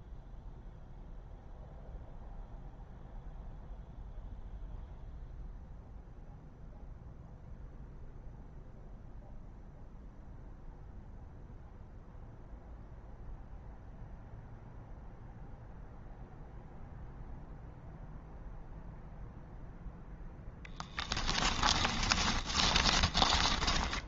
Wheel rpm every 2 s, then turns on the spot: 0, 0, 0, 0, 0, 0, 0, 0, 0, 0, 10, 20.
20-24